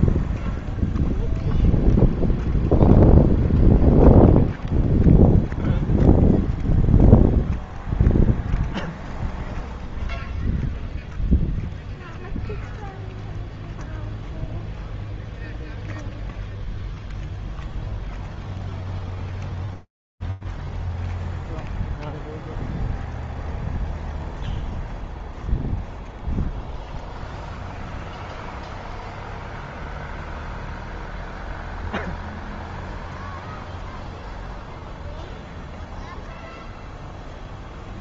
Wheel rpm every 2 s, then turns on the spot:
0, 0, 0, 0, 0, 0, 0, 0, 0, 0, 0, 0, 0, 0, 0, 0, 0, 0, 0.
none